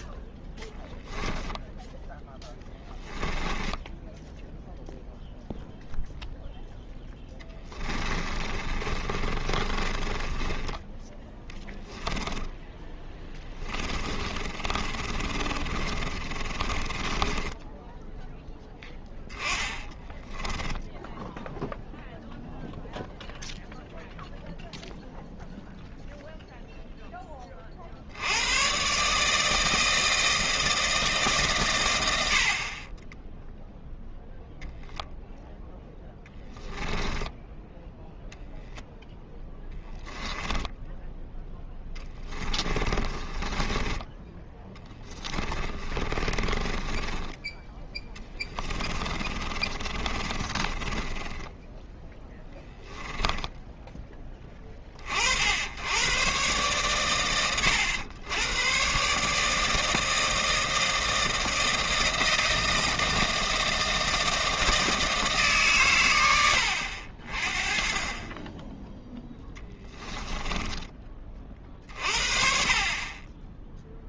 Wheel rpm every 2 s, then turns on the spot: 0, 10, 0, 0, 30, 10, 10, 30, 20, 10, 10, 0, 0, 10, 150, 150, 30, 0, 10, 0, 0, 20, 10, 20, 30, 20, 10, 50, 120, 140, 160, 160, 160, 60, 10, 30, 40.
2-4 8-10 12-18 20-22 36-38 42-54